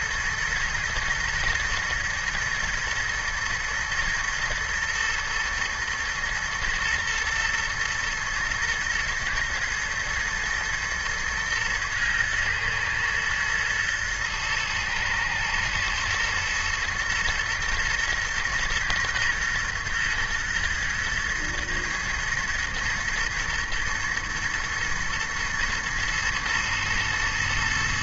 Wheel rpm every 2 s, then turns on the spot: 120, 120, 110, 110, 120, 120, 110, 110, 120, 120, 120, 110, 110, 110.
none